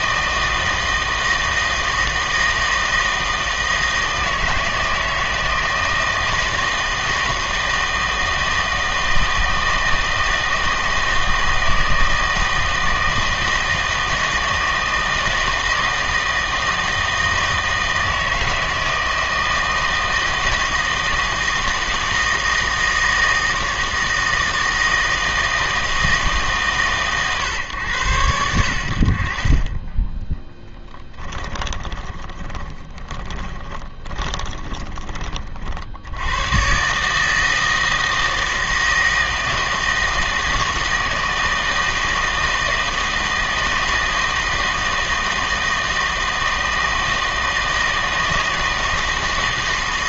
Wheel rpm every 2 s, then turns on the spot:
160, 160, 160, 160, 160, 160, 160, 160, 160, 160, 160, 160, 160, 140, 60, 10, 10, 10, 120, 160, 160, 160, 160, 160, 160.
30-36